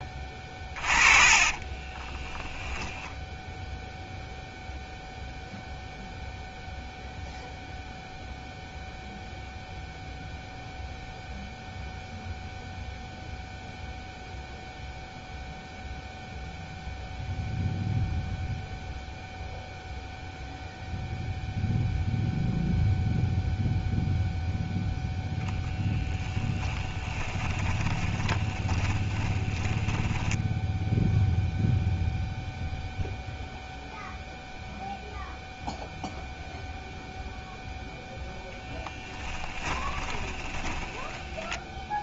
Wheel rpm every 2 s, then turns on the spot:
20, 10, 0, 0, 0, 0, 0, 0, 0, 0, 0, 0, 0, 20, 20, 0, 0, 0, 0, 0, 10.
0-2 26-30 40-42